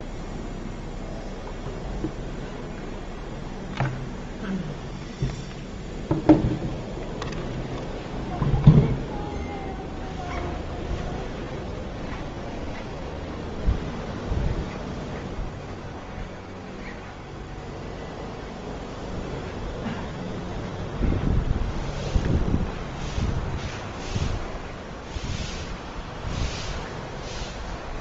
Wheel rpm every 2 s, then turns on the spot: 0, 0, 0, 0, 0, 0, 0, 0, 0, 0, 0, 0, 0, 0.
none